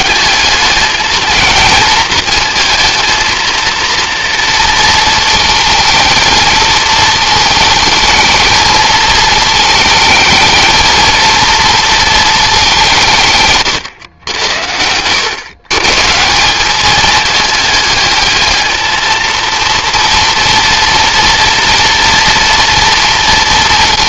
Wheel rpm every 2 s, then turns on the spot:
210, 220, 230, 220, 220, 230, 190, 100, 210, 220, 230, 230.
14-16